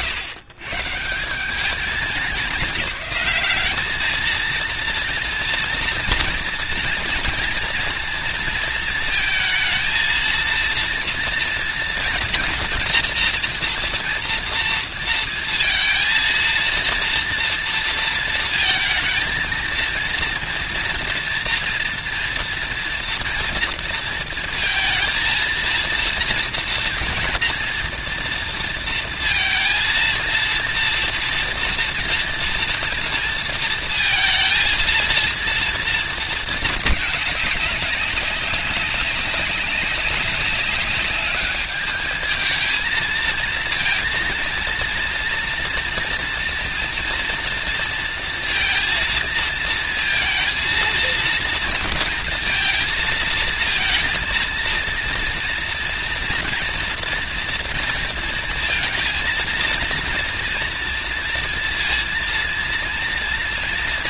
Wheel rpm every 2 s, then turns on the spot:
110, 200, 230, 230, 230, 230, 240, 230, 230, 230, 230, 230, 230, 240, 230, 230, 230, 230, 220, 190, 200, 220, 230, 230, 230, 230, 230, 230, 240, 230, 230, 230.
none